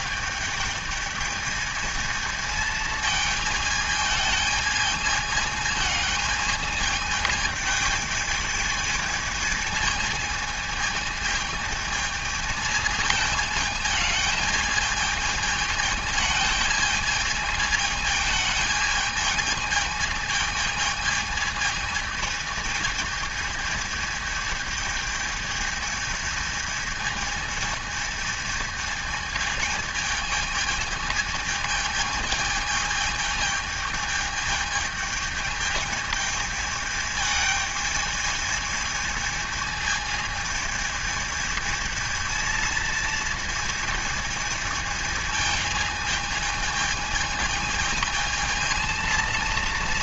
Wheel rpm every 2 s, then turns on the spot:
220, 220, 220, 220, 220, 220, 220, 220, 220, 220, 220, 220, 220, 220, 220, 220, 220, 220, 220, 220, 220, 230, 220, 220, 220.
none